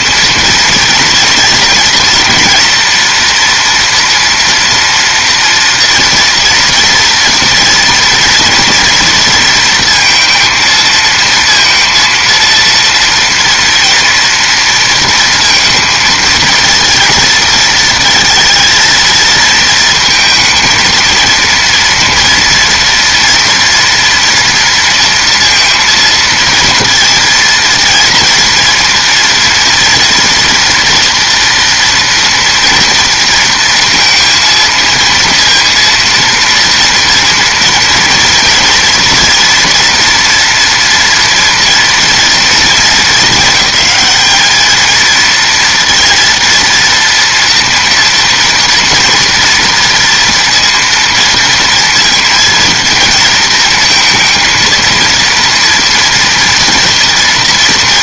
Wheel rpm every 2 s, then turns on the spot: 230, 230, 230, 230, 230, 220, 230, 230, 230, 230, 220, 230, 230, 230, 240, 240, 240, 230, 230, 230, 230, 230, 220, 230, 230, 230, 230, 230, 230.
none